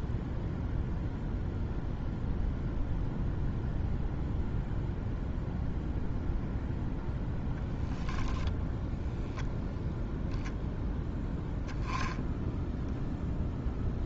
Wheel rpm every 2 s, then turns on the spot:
0, 0, 0, 0, 0, 0, 0.
none